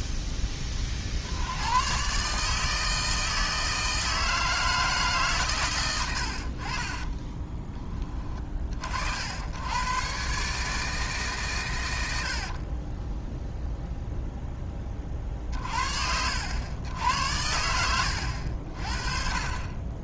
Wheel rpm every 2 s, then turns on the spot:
30, 160, 160, 40, 50, 150, 30, 20, 100, 50.
12-14